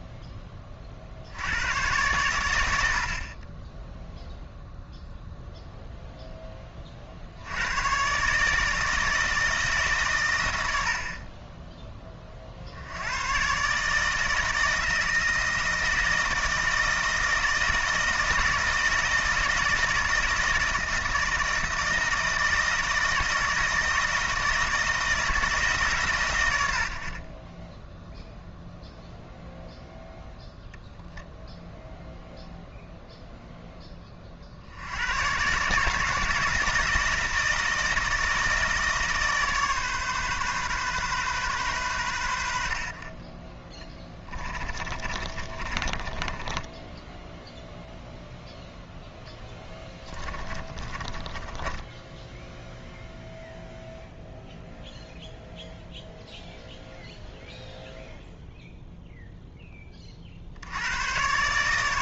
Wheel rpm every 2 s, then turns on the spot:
20, 90, 0, 10, 150, 90, 60, 160, 160, 170, 160, 160, 160, 100, 0, 10, 0, 50, 160, 160, 130, 70, 20, 10, 0, 30, 0, 0, 0, 0, 70.
44-48 50-52